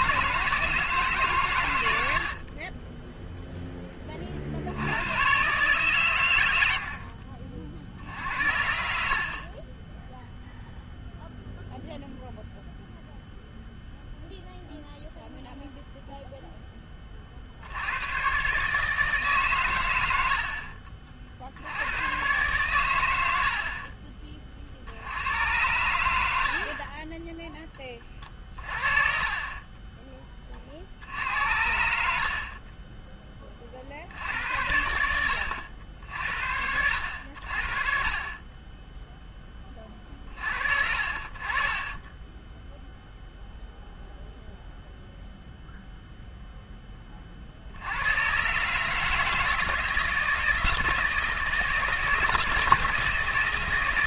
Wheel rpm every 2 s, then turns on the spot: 160, 30, 60, 80, 70, 0, 0, 0, 10, 140, 50, 120, 50, 50, 30, 60, 30, 80, 70, 10, 40, 0, 0, 10, 140, 160, 160.
2-4 8-10 20-22 26-28 32-34